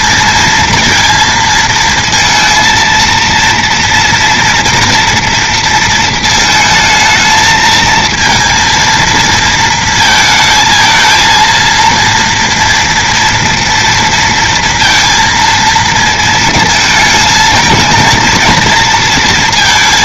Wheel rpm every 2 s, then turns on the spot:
230, 230, 230, 220, 230, 230, 230, 230, 230, 230.
none